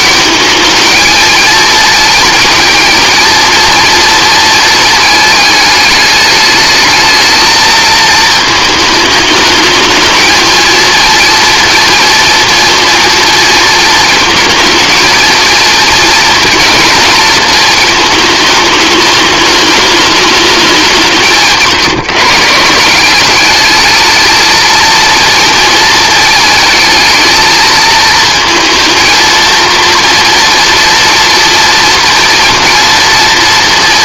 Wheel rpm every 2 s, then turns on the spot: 220, 230, 220, 220, 220, 230, 230, 230, 230, 220, 190, 150, 230, 220, 220, 230, 240.
none